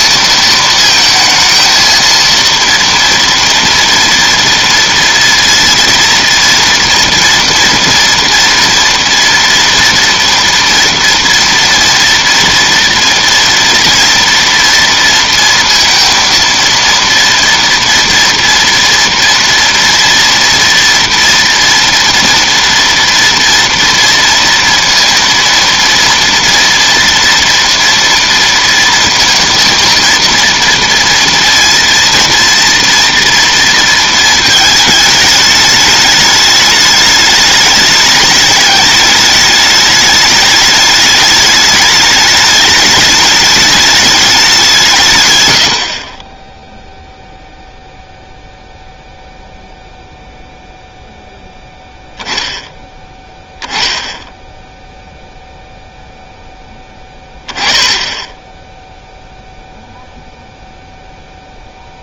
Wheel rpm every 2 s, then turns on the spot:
220, 230, 230, 230, 230, 240, 230, 230, 230, 230, 230, 230, 230, 230, 230, 230, 230, 220, 210, 210, 210, 210, 170, 0, 0, 0, 10, 0, 10, 10, 0.
none